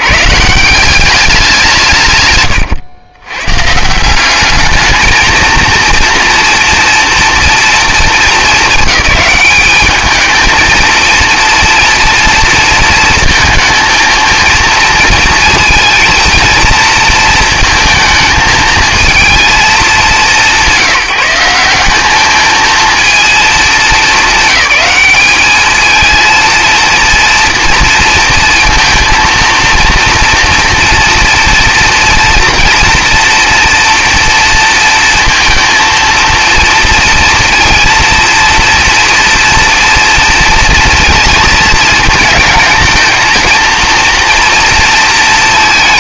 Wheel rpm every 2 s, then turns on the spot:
150, 130, 210, 240, 220, 220, 230, 230, 230, 220, 200, 220, 210, 230, 230, 230, 240, 230, 230, 230, 230, 220, 230.
2-4